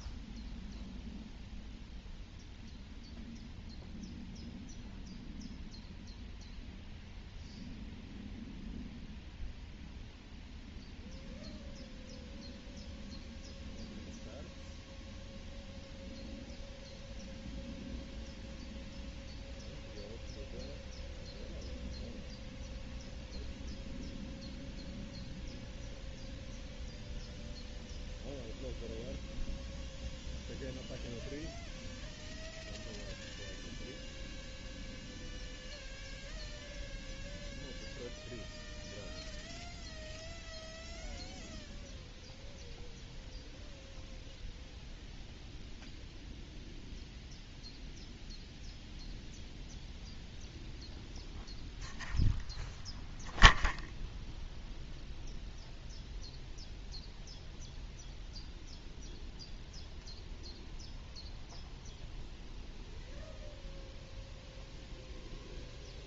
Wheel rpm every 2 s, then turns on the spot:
0, 0, 0, 0, 0, 0, 0, 0, 0, 0, 0, 0, 0, 0, 0, 0, 0, 0, 0, 0, 0, 0, 0, 0, 0, 0, 0, 0, 0, 0, 0, 0, 0.
none